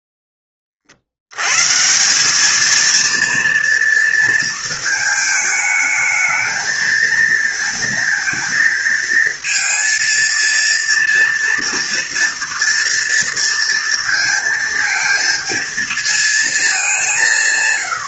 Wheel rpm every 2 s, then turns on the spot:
20, 220, 220, 220, 230, 230, 230, 230, 200.
none